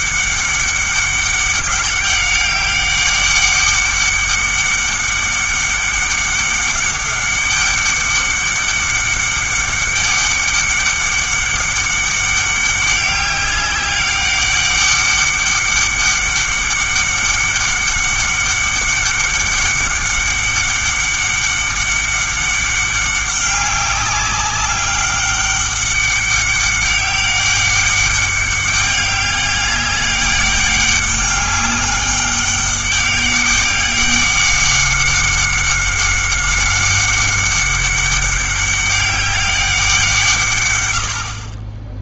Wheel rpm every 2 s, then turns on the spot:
200, 200, 200, 200, 200, 200, 200, 200, 200, 200, 200, 200, 200, 200, 200, 200, 200, 200, 190, 200, 130.
none